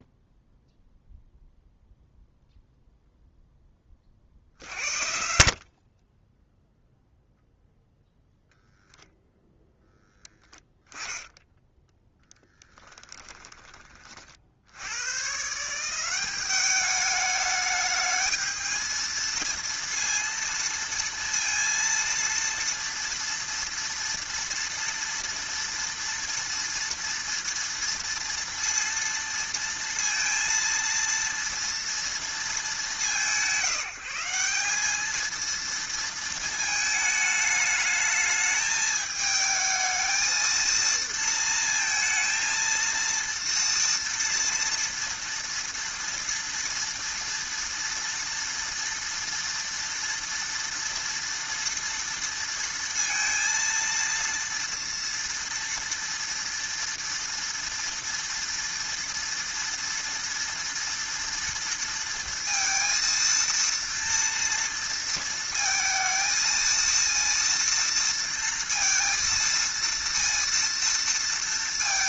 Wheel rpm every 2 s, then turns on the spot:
0, 0, 70, 0, 0, 10, 10, 100, 210, 220, 230, 230, 230, 240, 230, 230, 180, 210, 220, 220, 230, 230, 230, 230, 230, 230, 230, 230, 230, 230, 230, 230, 230, 230, 230, 230.
12-14